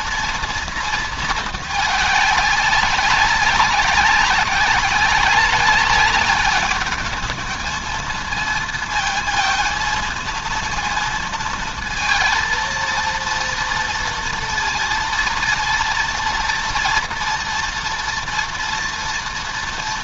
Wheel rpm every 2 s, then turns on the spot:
230, 200, 200, 200, 230, 230, 230, 230, 230, 230.
none